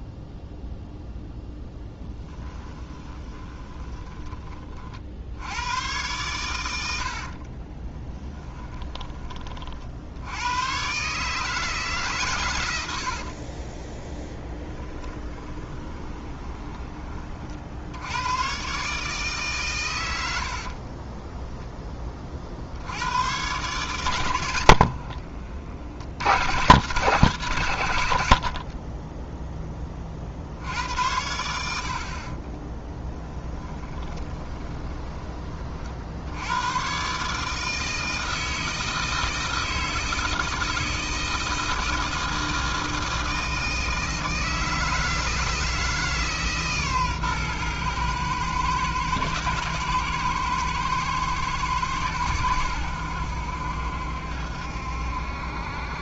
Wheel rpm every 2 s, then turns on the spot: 0, 10, 40, 90, 20, 130, 90, 10, 20, 130, 50, 80, 80, 140, 40, 80, 20, 20, 110, 160, 160, 160, 160, 140, 120, 120, 90, 70.
2-4 8-10 14-16 20-22 24-26 32-36